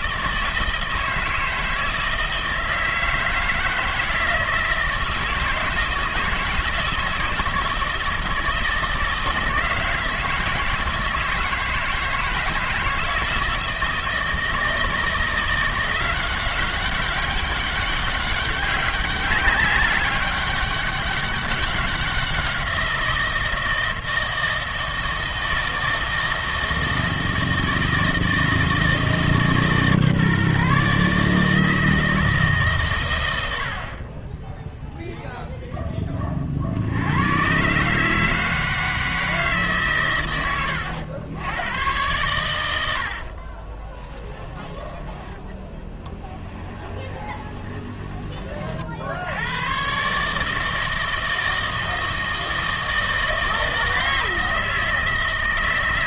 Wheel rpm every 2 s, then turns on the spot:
160, 160, 160, 160, 160, 160, 160, 160, 180, 200, 200, 180, 160, 160, 160, 150, 150, 10, 50, 160, 100, 100, 10, 10, 40, 150, 160, 160.
40-42 46-48